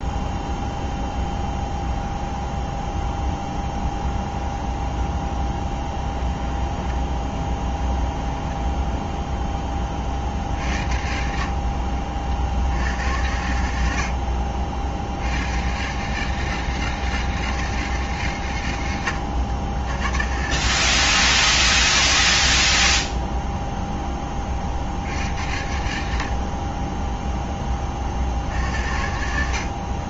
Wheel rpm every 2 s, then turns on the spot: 0, 0, 0, 10, 0, 60, 90, 60, 160, 110, 140, 50, 60, 20, 70.
6-8 18-20 22-24 26-28